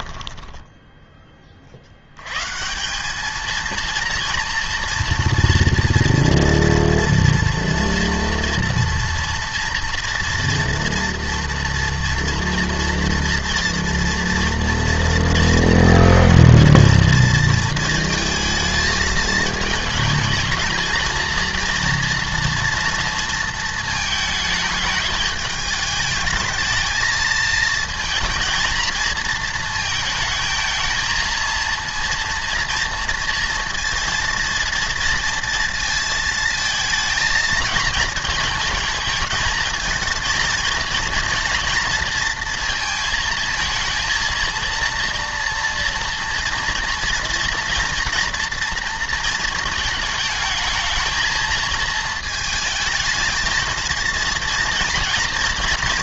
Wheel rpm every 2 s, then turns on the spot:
10, 170, 230, 230, 230, 230, 230, 230, 230, 220, 230, 230, 220, 220, 230, 220, 230, 230, 220, 220, 230, 220, 230, 230, 230, 220, 220, 230.
none